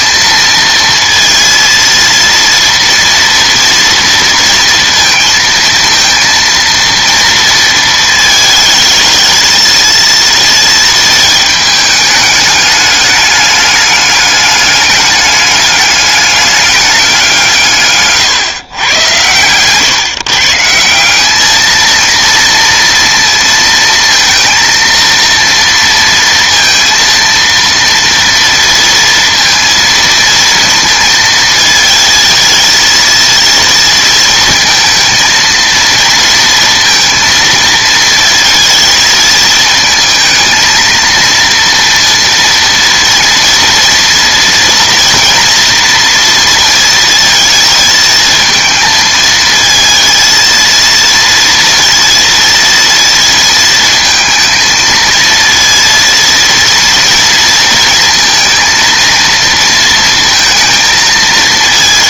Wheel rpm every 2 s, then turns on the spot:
230, 230, 230, 230, 220, 220, 210, 200, 200, 120, 160, 230, 230, 230, 230, 230, 220, 230, 230, 220, 230, 230, 230, 230, 220, 230, 230, 220, 230, 230, 220.
none